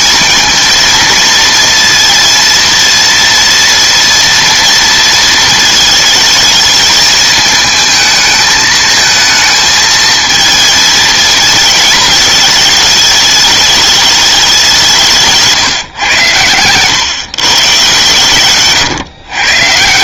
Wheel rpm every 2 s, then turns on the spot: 220, 230, 230, 220, 220, 230, 220, 200, 120, 130.
none